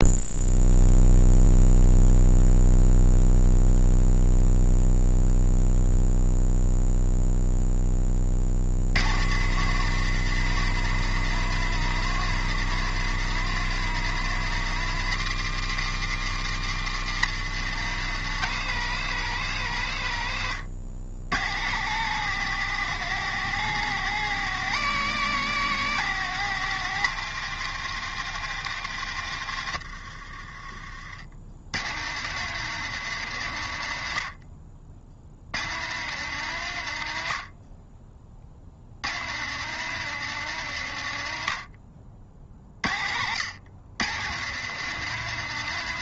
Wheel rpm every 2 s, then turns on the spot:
0, 0, 0, 0, 110, 160, 160, 150, 140, 160, 100, 170, 170, 170, 130, 50, 150, 60, 80, 100, 110, 60, 160.
none